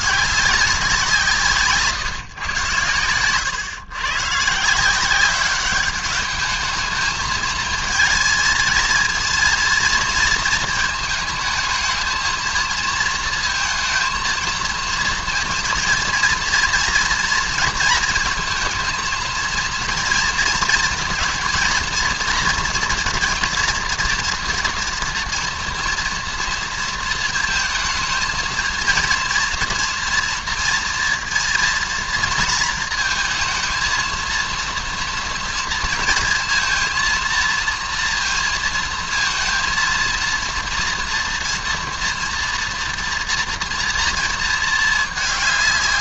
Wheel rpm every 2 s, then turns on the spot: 190, 110, 150, 210, 220, 220, 230, 220, 230, 230, 230, 240, 240, 230, 220, 230, 230, 230, 230, 230, 230, 230, 230.
none